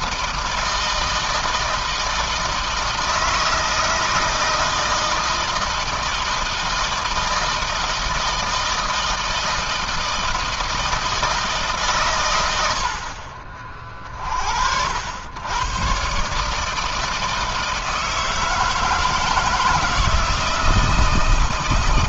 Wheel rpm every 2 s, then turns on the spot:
160, 160, 160, 160, 160, 160, 70, 70, 160, 160, 160.
none